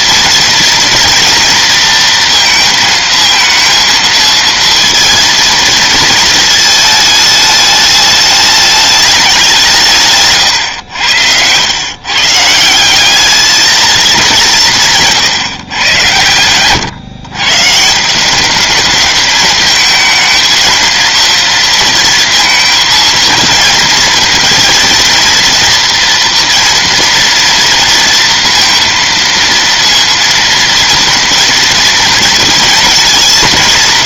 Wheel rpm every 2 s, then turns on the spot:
230, 230, 230, 220, 210, 120, 170, 180, 110, 210, 220, 230, 230, 230, 230, 230, 230.
none